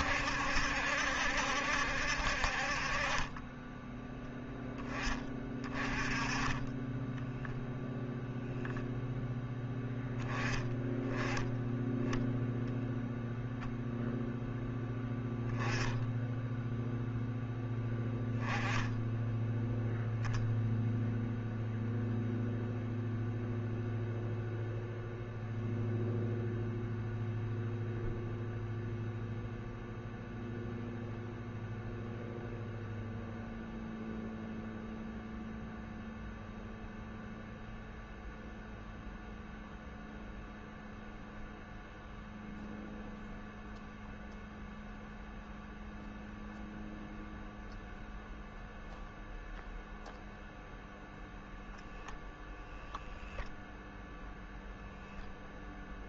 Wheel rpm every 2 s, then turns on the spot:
70, 40, 10, 20, 0, 10, 0, 10, 0, 10, 0, 0, 0, 0, 0, 0, 0, 0, 0, 0, 0, 0, 0, 0, 0, 0, 0, 0.
none